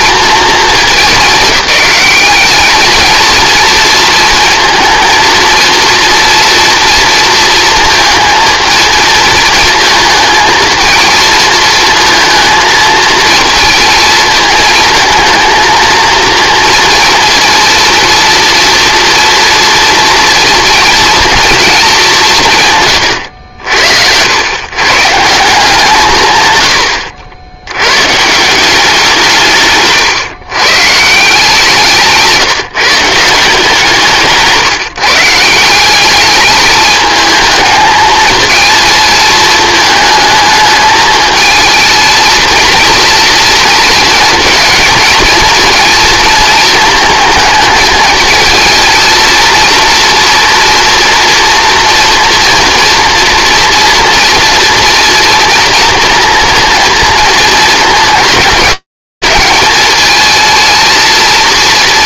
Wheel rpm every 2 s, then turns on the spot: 210, 210, 230, 230, 230, 220, 220, 220, 230, 240, 240, 160, 110, 120, 180, 130, 160, 160, 210, 230, 220, 230, 230, 230, 230, 230, 240, 230, 230, 210, 230.
none